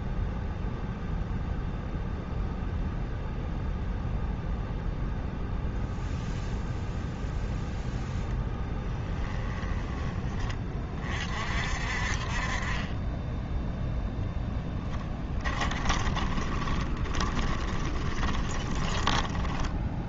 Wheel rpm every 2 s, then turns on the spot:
0, 0, 0, 0, 10, 40, 20, 10, 20, 10.
8-10 14-20